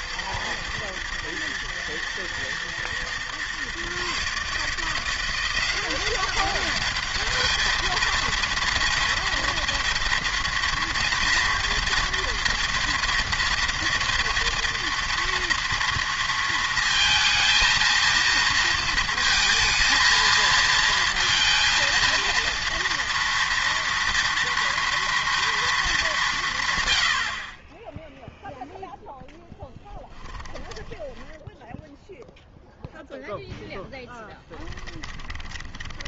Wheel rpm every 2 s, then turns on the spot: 110, 120, 160, 200, 230, 230, 230, 230, 230, 230, 220, 230, 230, 130, 0, 10, 0, 10.
30-32 34-36